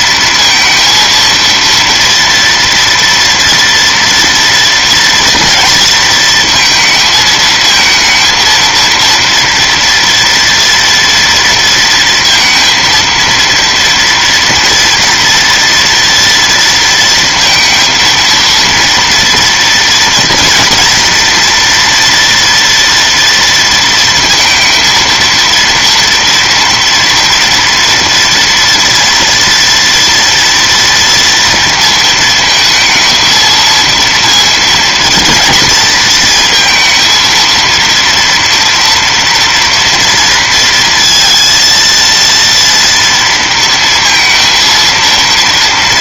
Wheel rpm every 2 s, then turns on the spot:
230, 240, 230, 220, 230, 230, 230, 230, 230, 230, 240, 230, 230, 230, 230, 230, 230, 230, 230, 230, 230, 230, 230.
none